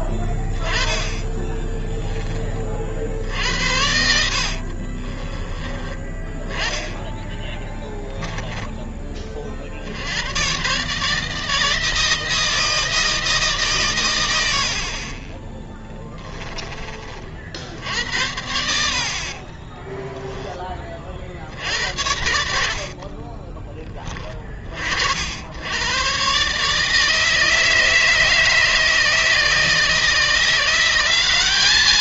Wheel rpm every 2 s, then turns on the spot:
10, 30, 60, 20, 10, 120, 160, 80, 20, 80, 20, 80, 40, 140, 150, 170.
4-6 22-24